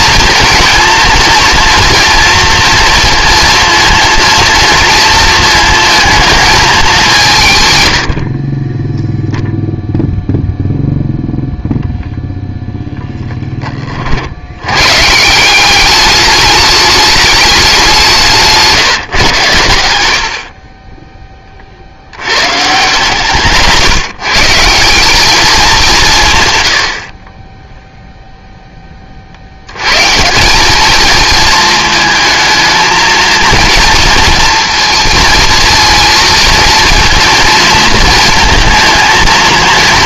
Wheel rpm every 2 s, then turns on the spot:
230, 230, 230, 200, 20, 0, 0, 100, 210, 160, 30, 140, 180, 80, 20, 210, 220, 230, 220, 220.
none